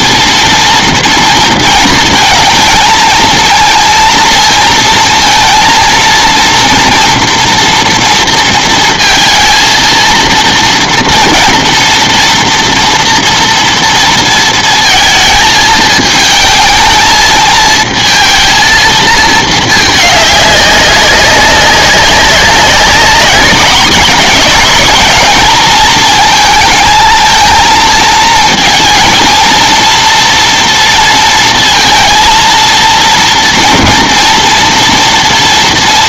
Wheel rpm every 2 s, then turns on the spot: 230, 230, 230, 230, 230, 230, 240, 230, 220, 230, 200, 200, 230, 220, 230, 230, 230, 240.
none